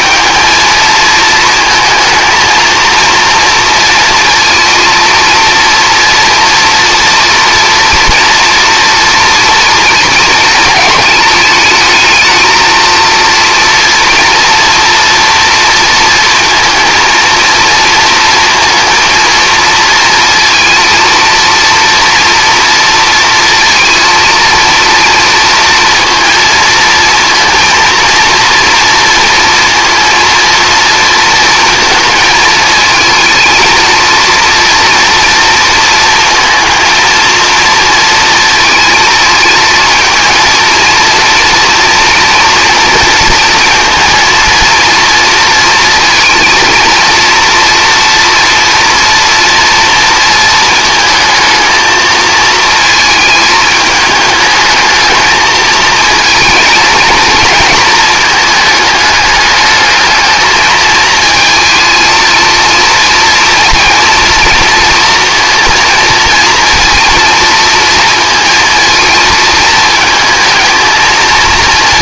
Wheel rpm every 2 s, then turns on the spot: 230, 230, 230, 230, 240, 220, 230, 240, 230, 230, 230, 230, 230, 230, 240, 230, 230, 230, 230, 230, 230, 240, 230, 230, 230, 230, 220, 220, 230, 220, 220, 230, 230, 230, 230, 230.
none